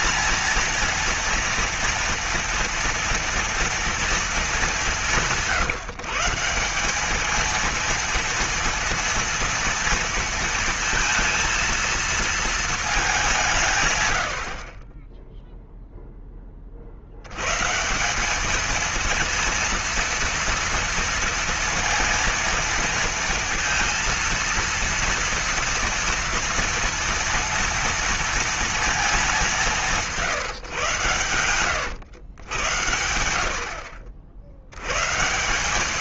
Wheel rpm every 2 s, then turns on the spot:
230, 230, 200, 180, 230, 230, 220, 40, 40, 220, 230, 230, 230, 230, 230, 140, 90, 100.
none